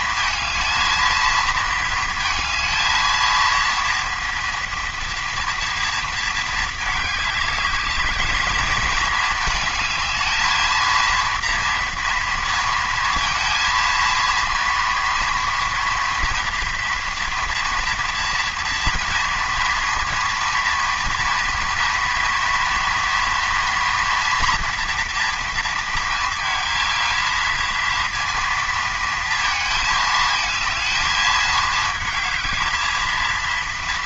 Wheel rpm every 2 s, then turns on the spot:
220, 230, 230, 220, 220, 230, 230, 230, 230, 230, 230, 230, 240, 230, 230, 220, 220.
none